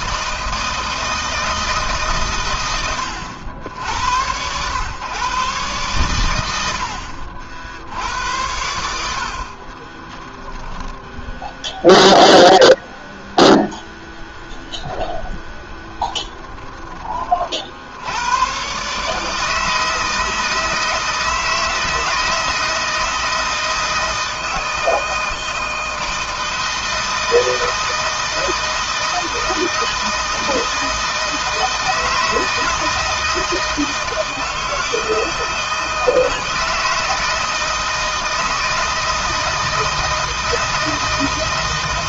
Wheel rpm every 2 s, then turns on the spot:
160, 100, 120, 70, 70, 10, 0, 0, 20, 130, 160, 160, 160, 160, 160, 160, 160, 160, 160, 160, 160.
none